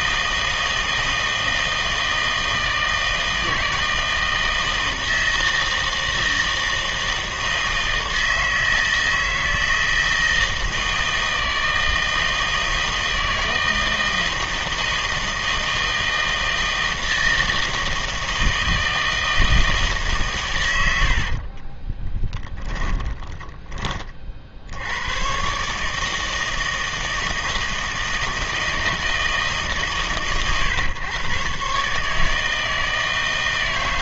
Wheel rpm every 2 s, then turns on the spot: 160, 160, 160, 160, 160, 160, 160, 160, 160, 160, 100, 10, 70, 160, 160, 120, 160.
22-24